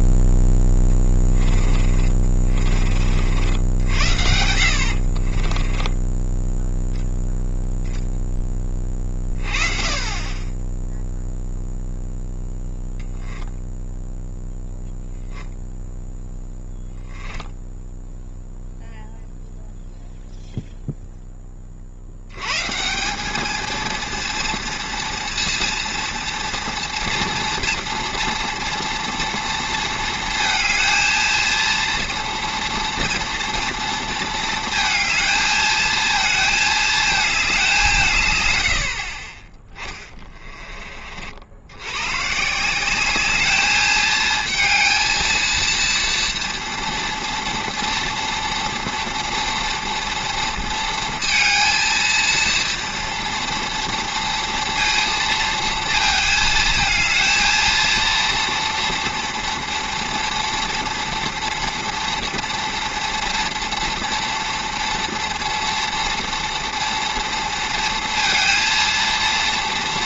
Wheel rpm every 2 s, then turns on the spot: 10, 40, 60, 0, 20, 10, 0, 0, 10, 0, 0, 140, 230, 230, 240, 220, 230, 220, 220, 90, 30, 170, 230, 230, 230, 230, 230, 230, 220, 230, 230, 230, 230, 230, 230.
0-2 4-6 16-18